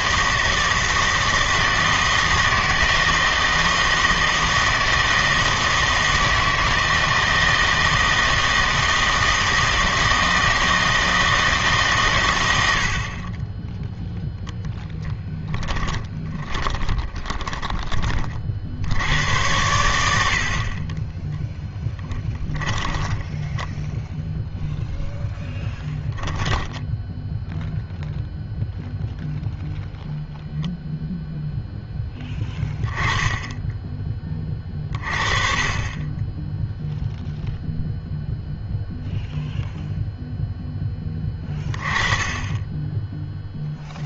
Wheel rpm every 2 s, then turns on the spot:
160, 160, 160, 160, 160, 160, 80, 0, 20, 70, 40, 10, 0, 10, 0, 0, 10, 30, 0, 0, 10, 10.
16-18 22-24 26-28